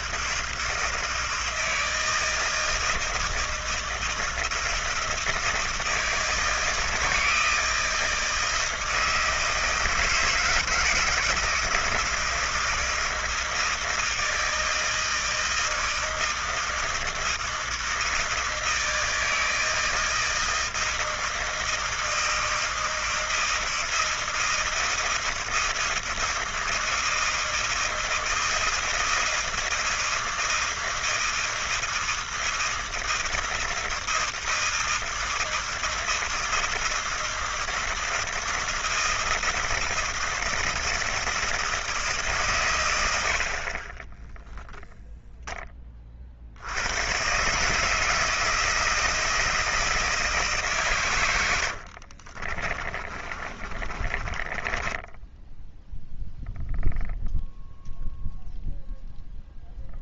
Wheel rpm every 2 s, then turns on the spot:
160, 160, 160, 160, 160, 160, 160, 160, 160, 160, 160, 160, 160, 160, 160, 160, 160, 160, 160, 160, 160, 120, 0, 70, 160, 140, 30, 20, 0, 0.
52-56